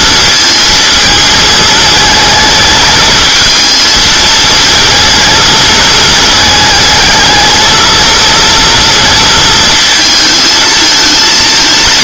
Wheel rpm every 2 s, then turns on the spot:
230, 220, 230, 220, 230, 220.
none